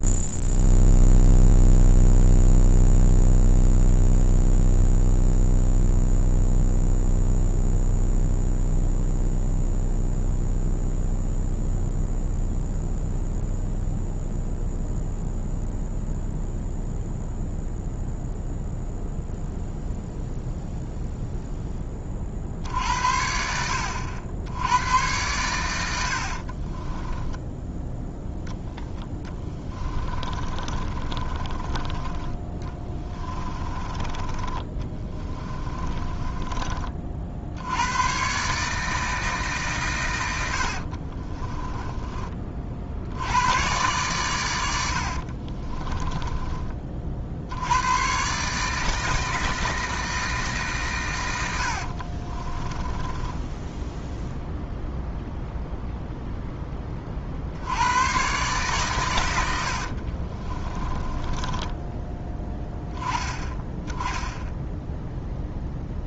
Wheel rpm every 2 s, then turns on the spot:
0, 0, 0, 0, 0, 0, 0, 0, 0, 0, 0, 60, 100, 30, 10, 30, 20, 20, 30, 150, 60, 60, 80, 40, 150, 130, 20, 0, 20, 130, 30, 10, 0.
26-36 40-42 44-46 52-54 60-62